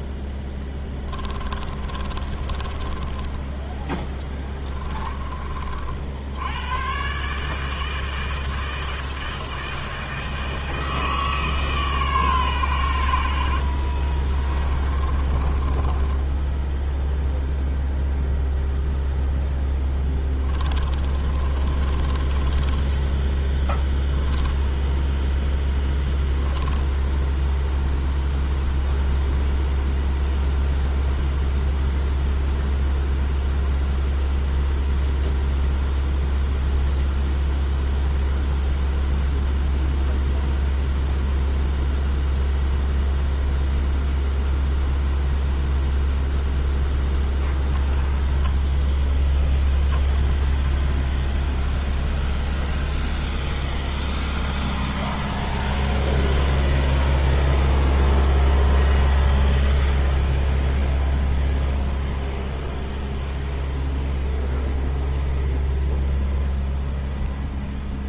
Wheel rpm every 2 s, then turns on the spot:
20, 20, 20, 120, 160, 160, 90, 20, 0, 0, 30, 10, 0, 10, 0, 0, 0, 0, 0, 0, 0, 0, 0, 0, 0, 0, 0, 0, 0, 0, 0, 0, 0, 0.
0-6 14-16 20-24 26-28